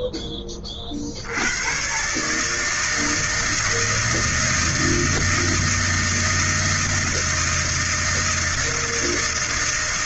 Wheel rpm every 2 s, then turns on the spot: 20, 160, 160, 160, 160.
none